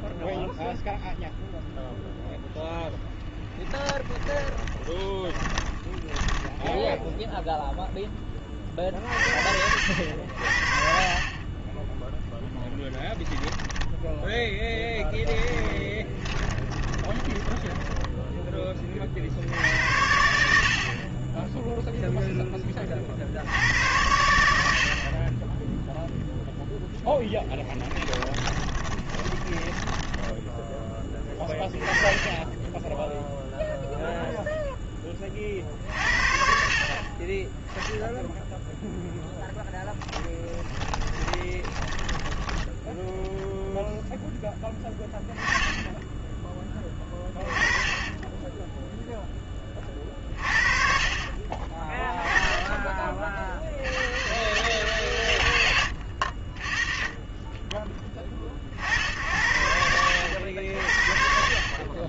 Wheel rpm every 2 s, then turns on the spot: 10, 0, 20, 10, 30, 60, 10, 10, 20, 10, 70, 10, 80, 0, 10, 10, 10, 0, 40, 0, 10, 10, 10, 10, 10, 40, 10, 120, 50, 50, 60.
4-8 16-18 28-30 40-44